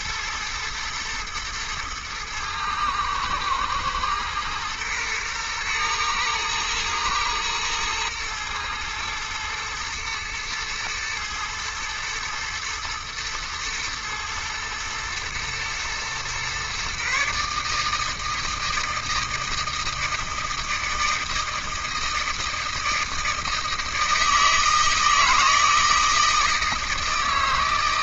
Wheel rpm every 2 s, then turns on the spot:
110, 110, 110, 110, 110, 110, 110, 120, 130, 160, 160, 160, 160, 160.
none